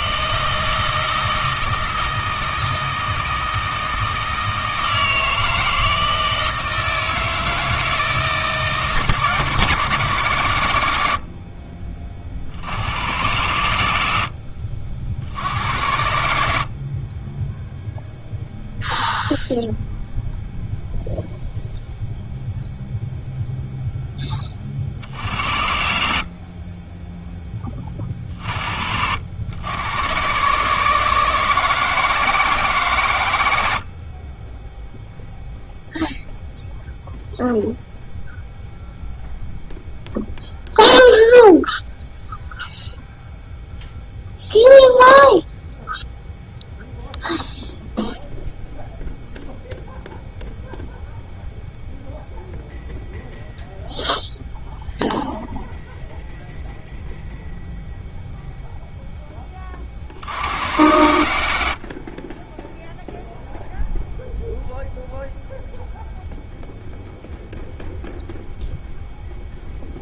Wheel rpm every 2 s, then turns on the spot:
160, 160, 160, 160, 150, 110, 80, 60, 50, 0, 0, 0, 50, 20, 50, 140, 140, 0, 0, 0, 0, 0, 0, 0, 0, 0, 0, 0, 0, 0, 90, 0, 0, 0, 0.
none